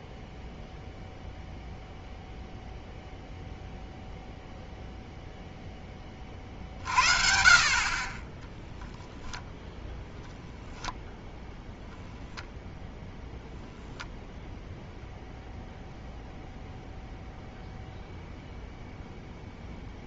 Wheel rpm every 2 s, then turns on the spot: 0, 0, 0, 50, 0, 0, 0, 0, 0, 0.
none